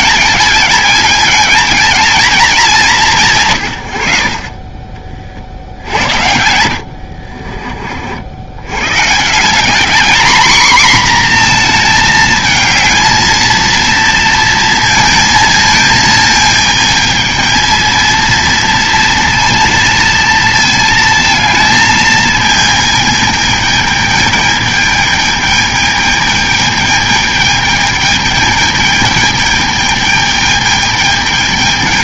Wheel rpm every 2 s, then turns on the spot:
220, 210, 50, 80, 90, 240, 220, 230, 220, 230, 230, 220, 210, 210, 210, 210.
6-8